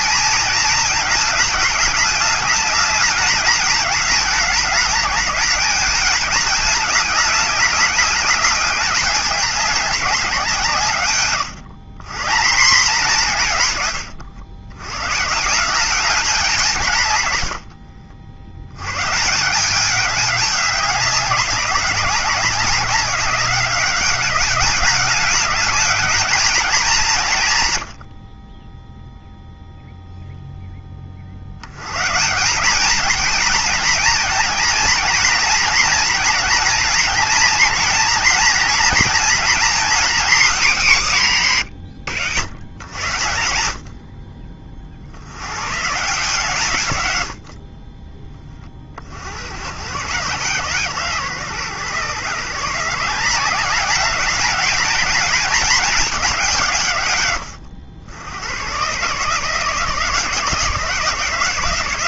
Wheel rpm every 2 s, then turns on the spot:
220, 210, 210, 210, 210, 160, 190, 120, 170, 100, 200, 190, 200, 200, 10, 10, 200, 230, 230, 240, 220, 100, 60, 130, 40, 130, 160, 210, 140, 130, 150.
none